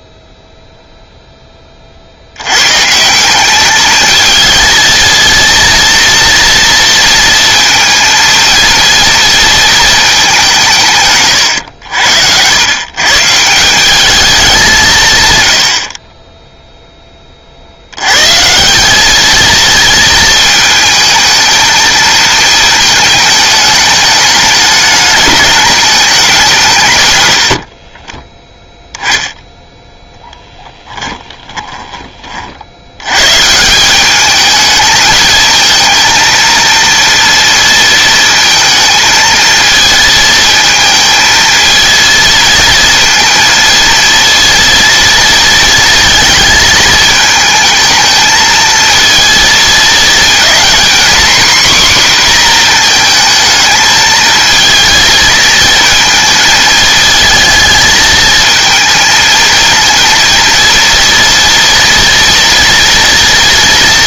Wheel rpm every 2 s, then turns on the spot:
0, 120, 220, 230, 230, 170, 110, 180, 10, 170, 220, 220, 210, 160, 10, 10, 70, 210, 230, 230, 220, 220, 230, 220, 220, 240, 240, 220, 220, 230, 230, 230.
none